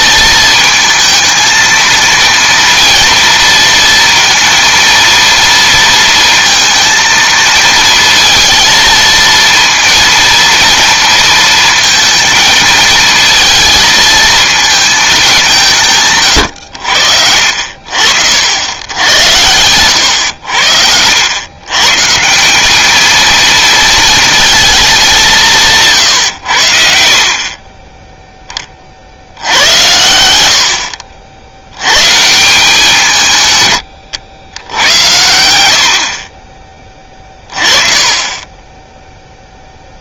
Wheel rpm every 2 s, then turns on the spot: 220, 230, 230, 230, 230, 230, 220, 220, 90, 90, 80, 210, 210, 60, 40, 60, 160, 90, 20, 10.
26-28